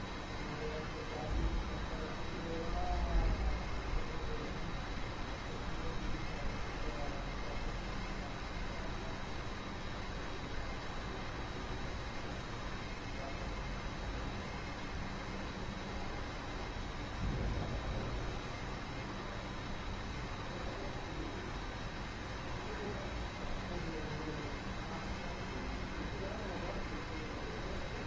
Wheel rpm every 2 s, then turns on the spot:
0, 0, 0, 0, 0, 0, 0, 0, 0, 0, 0, 0, 0, 0.
none